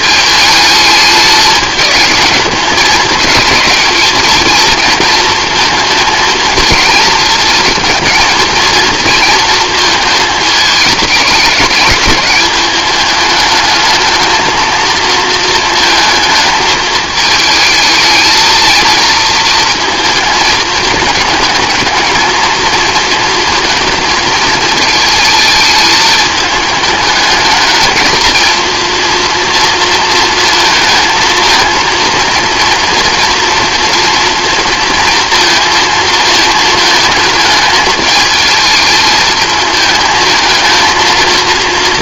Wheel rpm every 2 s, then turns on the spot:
220, 210, 220, 220, 220, 210, 200, 230, 220, 230, 220, 230, 220, 220, 230, 220, 230, 230, 220, 220, 230.
none